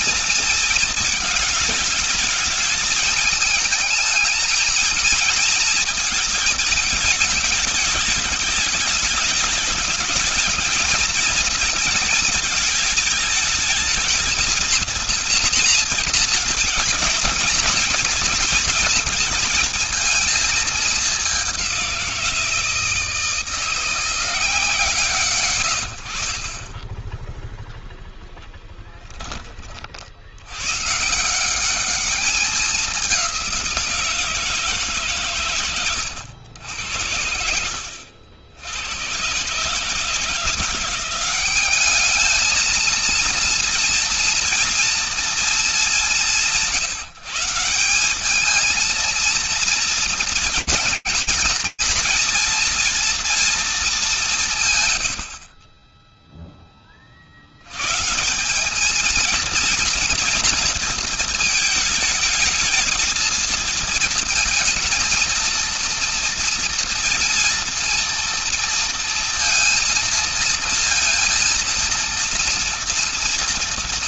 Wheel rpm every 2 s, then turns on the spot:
220, 220, 220, 220, 210, 220, 220, 230, 220, 230, 220, 170, 160, 20, 10, 120, 200, 160, 80, 100, 180, 230, 230, 160, 220, 220, 230, 170, 20, 210, 230, 220, 230, 230, 230, 230, 230.
none